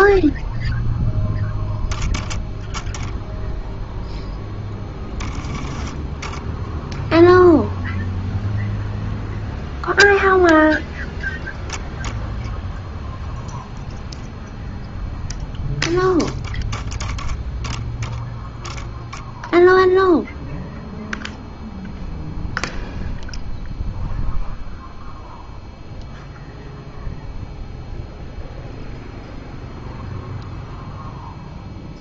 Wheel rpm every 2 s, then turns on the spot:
0, 0, 10, 0, 0, 0, 0, 0, 10, 0, 0, 0, 0, 0, 0, 0.
none